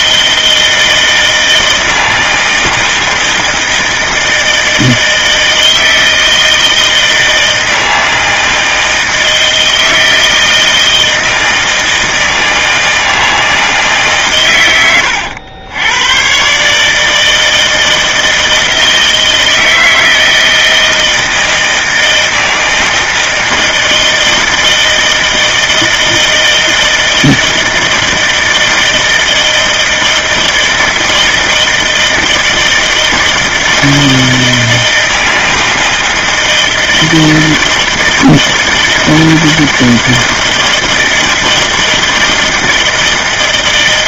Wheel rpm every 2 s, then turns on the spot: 160, 160, 160, 160, 160, 160, 160, 130, 140, 160, 160, 160, 160, 160, 160, 160, 160, 160, 160, 160, 160, 160.
none